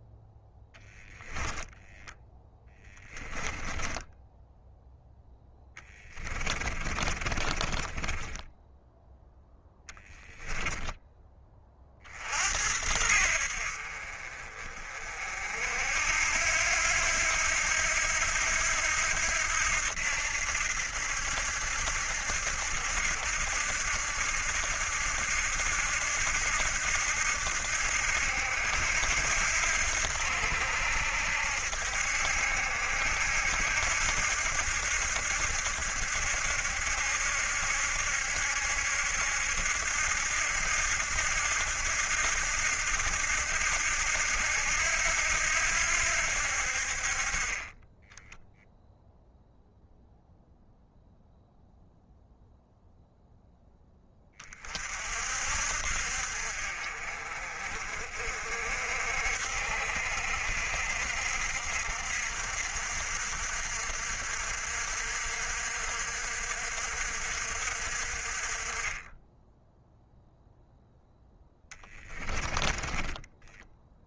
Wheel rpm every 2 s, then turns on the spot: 10, 10, 0, 30, 0, 10, 70, 40, 80, 80, 70, 80, 70, 80, 80, 70, 70, 70, 70, 70, 80, 80, 80, 50, 0, 0, 0, 40, 50, 60, 60, 60, 60, 60, 20, 0, 20.
2-4 6-8 72-74